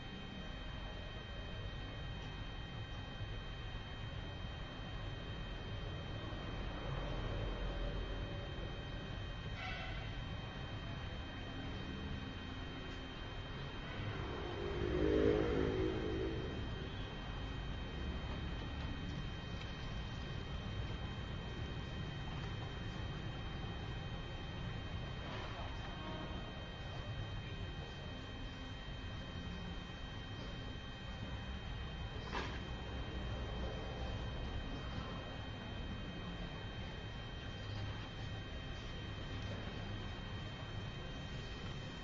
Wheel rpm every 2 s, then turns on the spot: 0, 0, 0, 0, 0, 0, 0, 0, 0, 0, 0, 0, 0, 0, 0, 0, 0, 0, 0, 0, 0.
none